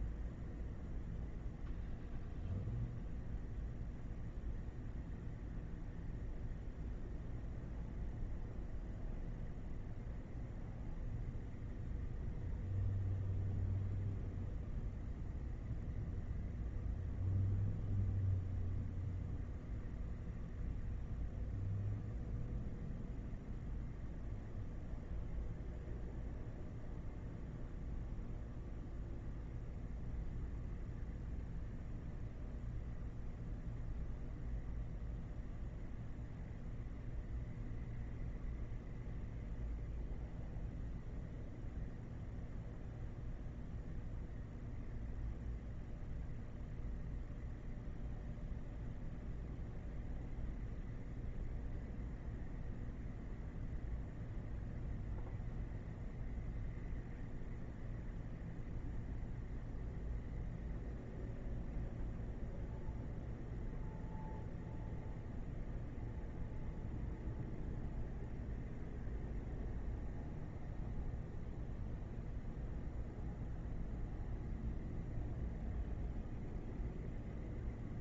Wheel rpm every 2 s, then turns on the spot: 0, 0, 0, 0, 0, 0, 0, 0, 0, 0, 0, 0, 0, 0, 0, 0, 0, 0, 0, 0, 0, 0, 0, 0, 0, 0, 0, 0, 0, 0, 0, 0, 0, 0, 0, 0, 0, 0, 0.
none